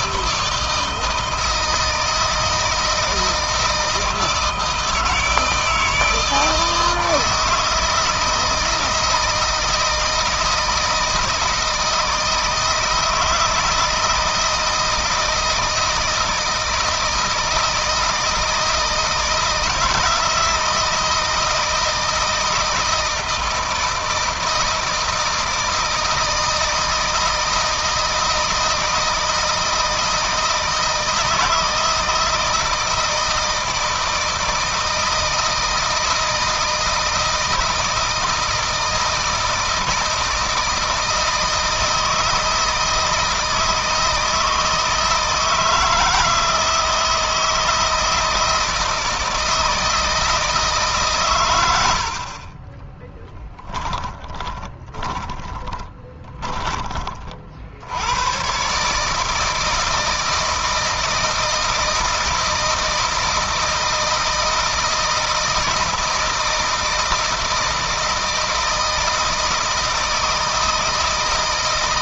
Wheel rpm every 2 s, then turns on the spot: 160, 160, 160, 160, 160, 160, 160, 160, 160, 160, 160, 160, 160, 160, 160, 160, 160, 160, 160, 160, 160, 160, 160, 160, 160, 150, 20, 20, 30, 140, 160, 160, 160, 160, 160, 160.
52-56